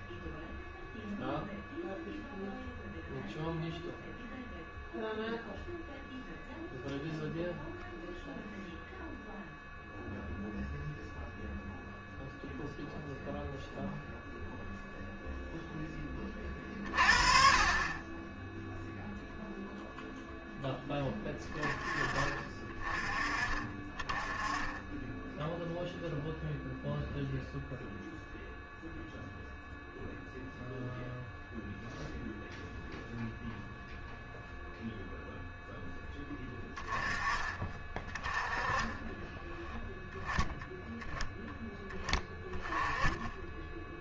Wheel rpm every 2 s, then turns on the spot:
0, 0, 0, 0, 0, 0, 0, 0, 40, 0, 10, 30, 10, 0, 0, 0, 0, 0, 10, 20, 10, 10.
38-40 42-44